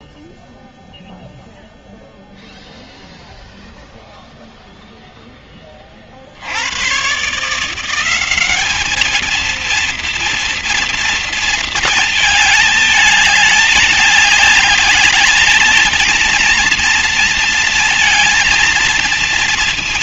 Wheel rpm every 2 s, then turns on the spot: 0, 0, 0, 40, 180, 230, 220, 210, 230, 230.
none